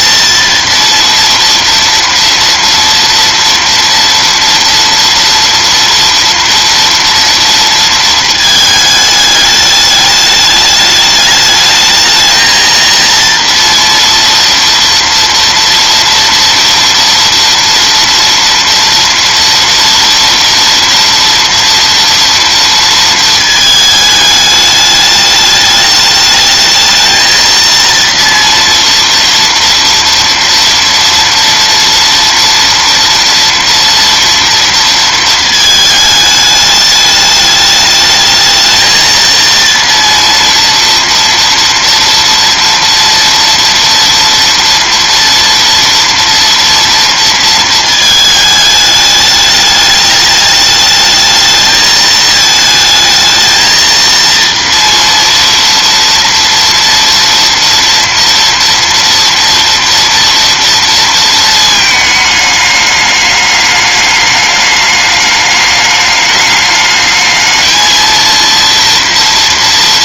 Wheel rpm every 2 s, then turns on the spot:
230, 230, 230, 230, 210, 210, 230, 230, 230, 230, 230, 220, 210, 220, 230, 230, 240, 220, 210, 230, 230, 230, 230, 230, 210, 220, 220, 230, 230, 230, 230, 210, 210, 220, 230.
none